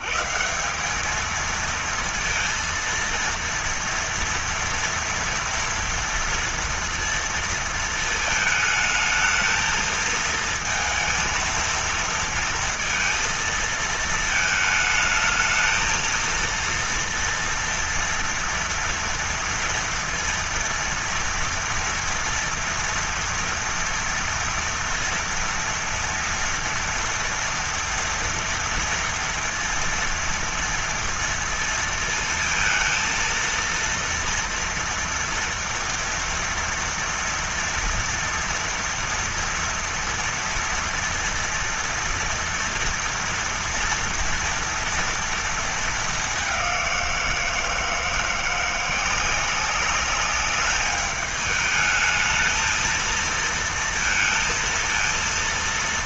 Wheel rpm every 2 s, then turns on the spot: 90, 230, 230, 230, 220, 230, 230, 220, 230, 240, 230, 240, 230, 230, 230, 230, 220, 230, 230, 240, 230, 230, 230, 210, 170, 200, 220, 220.
none